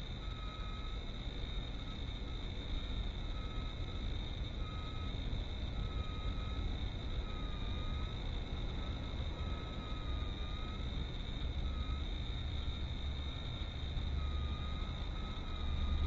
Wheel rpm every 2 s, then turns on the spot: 0, 0, 0, 0, 0, 0, 0, 0.
none